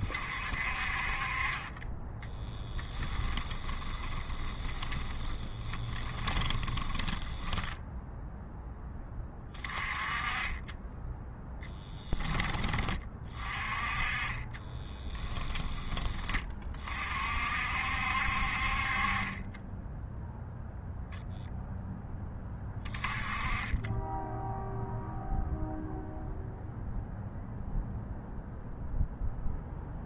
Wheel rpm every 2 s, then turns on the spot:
40, 10, 20, 20, 10, 20, 20, 20, 30, 50, 0, 20, 0, 0, 0.
2-8 14-16